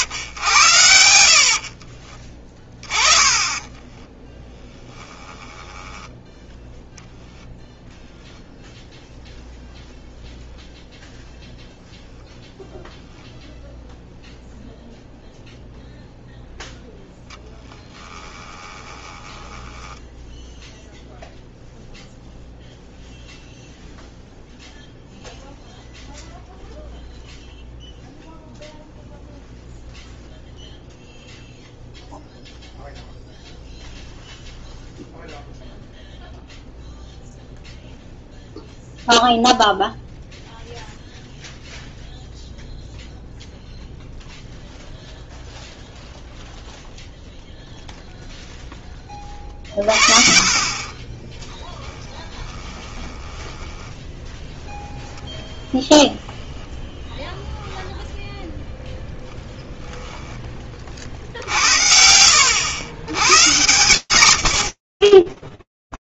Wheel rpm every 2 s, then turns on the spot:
50, 20, 10, 0, 0, 0, 0, 0, 10, 10, 0, 0, 0, 0, 0, 0, 0, 0, 0, 0, 0, 0, 0, 0, 10, 30, 20, 10, 10, 0, 20, 90, 70.
2-6 16-20 52-56 62-64